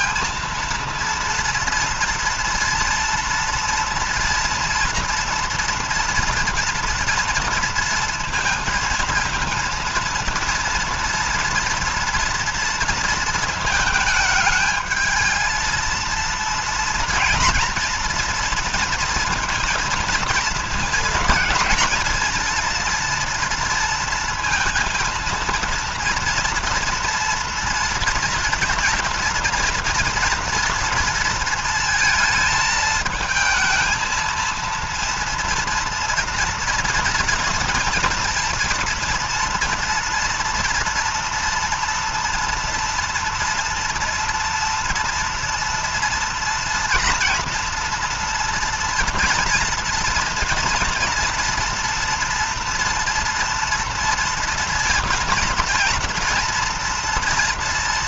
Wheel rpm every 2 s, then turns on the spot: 230, 230, 230, 230, 230, 230, 230, 220, 230, 240, 230, 230, 230, 230, 230, 240, 220, 230, 230, 230, 230, 230, 230, 230, 230, 240, 240, 230, 230.
none